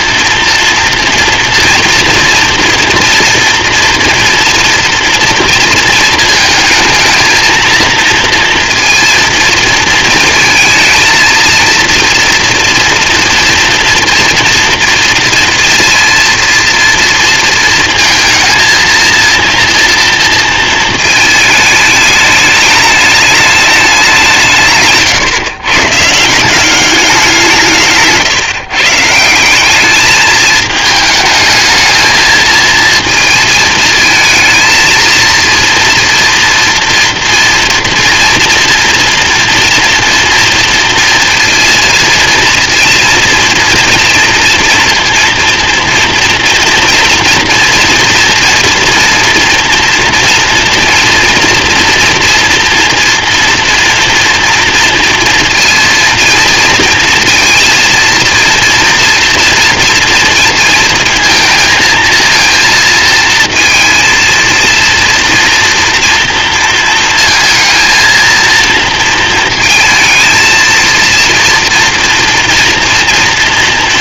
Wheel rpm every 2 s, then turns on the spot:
230, 230, 230, 220, 230, 220, 230, 230, 230, 230, 220, 210, 140, 200, 150, 220, 230, 220, 230, 230, 230, 230, 230, 240, 230, 230, 230, 230, 230, 230, 220, 230, 230, 230, 230, 230, 230.
none